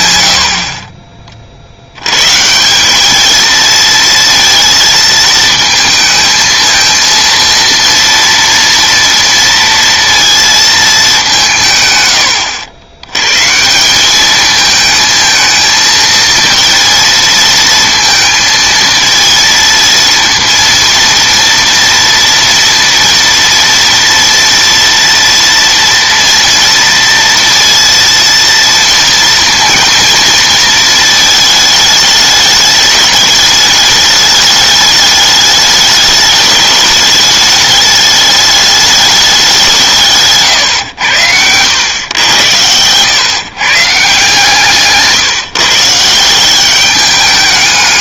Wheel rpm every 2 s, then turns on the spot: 30, 170, 230, 230, 230, 220, 80, 220, 230, 220, 230, 230, 230, 230, 230, 230, 210, 210, 210, 210, 110, 110, 160, 190.
none